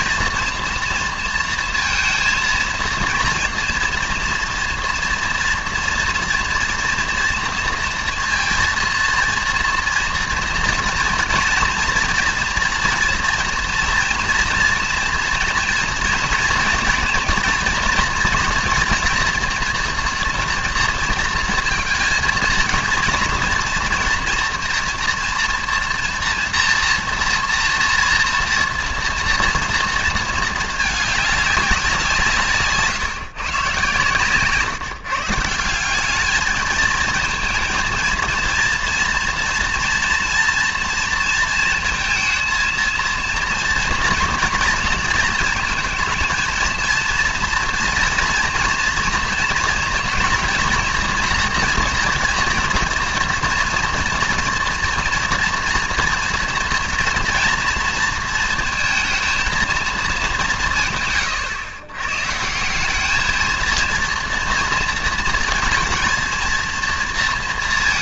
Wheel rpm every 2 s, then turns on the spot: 230, 230, 240, 240, 230, 230, 230, 230, 230, 230, 240, 230, 230, 230, 230, 220, 160, 150, 220, 230, 240, 230, 230, 230, 240, 230, 230, 230, 230, 230, 160, 170, 230, 230.
none